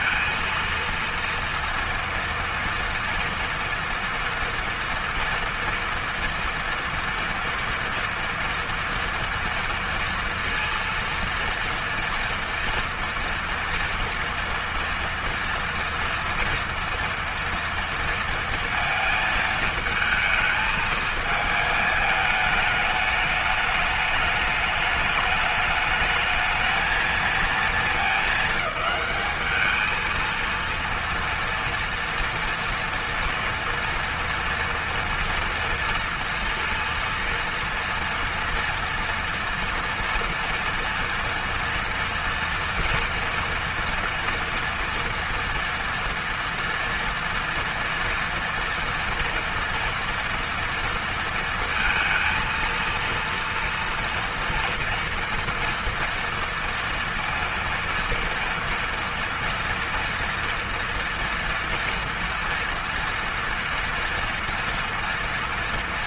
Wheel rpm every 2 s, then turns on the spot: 230, 230, 230, 230, 230, 230, 230, 230, 230, 230, 220, 210, 210, 220, 220, 230, 230, 240, 230, 230, 230, 230, 230, 230, 230, 240, 230, 230, 230, 230, 230, 230, 240.
none